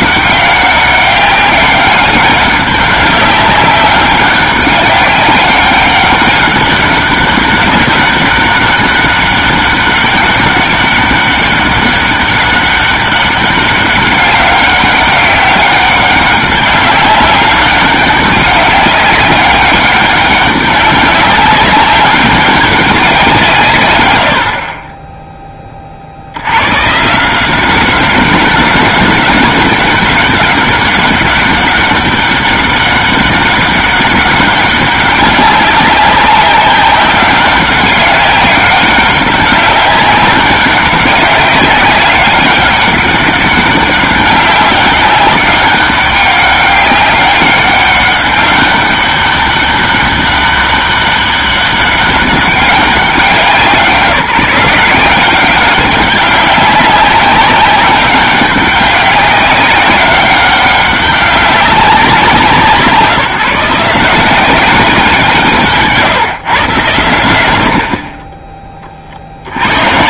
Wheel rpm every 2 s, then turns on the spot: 200, 200, 200, 200, 200, 200, 200, 200, 200, 190, 200, 200, 30, 150, 200, 190, 200, 200, 190, 190, 200, 200, 200, 200, 200, 200, 200, 180, 190, 200, 200, 170, 190, 120, 40.
none